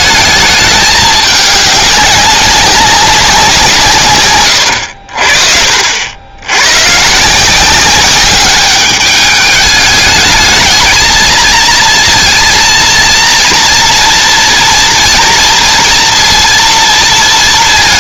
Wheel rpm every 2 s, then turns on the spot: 210, 190, 70, 130, 200, 220, 230, 230, 230.
none